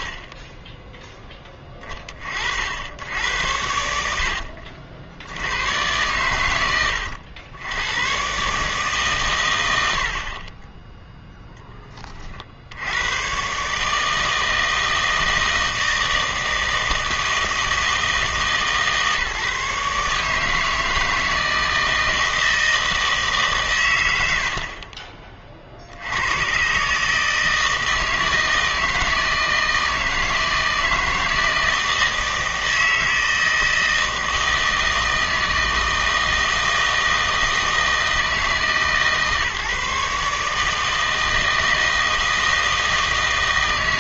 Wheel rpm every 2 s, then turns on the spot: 10, 70, 60, 100, 140, 10, 70, 160, 160, 150, 160, 160, 40, 120, 160, 160, 160, 160, 160, 150, 150, 160.
10-12 24-26